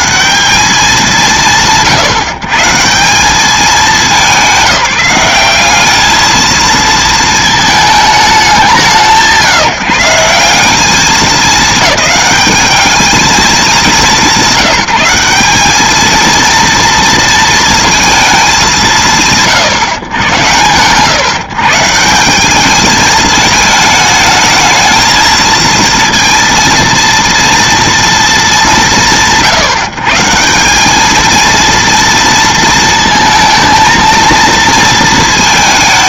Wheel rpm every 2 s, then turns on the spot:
180, 140, 170, 230, 180, 170, 210, 190, 230, 180, 90, 190, 220, 230, 190, 180, 230, 230.
none